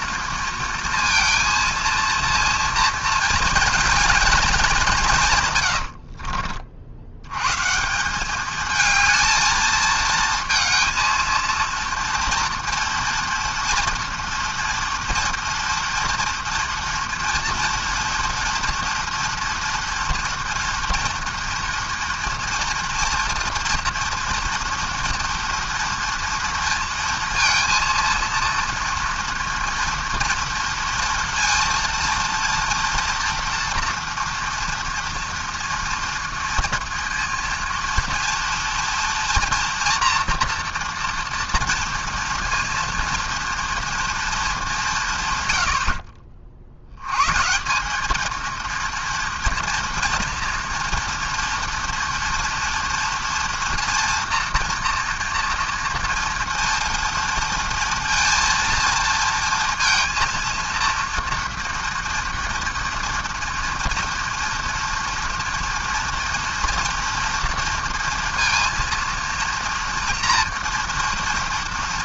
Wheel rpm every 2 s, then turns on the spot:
230, 230, 220, 60, 210, 230, 230, 230, 230, 230, 230, 240, 230, 230, 230, 230, 230, 230, 230, 230, 230, 230, 190, 50, 230, 230, 230, 240, 230, 230, 230, 230, 230, 230, 230, 230.
none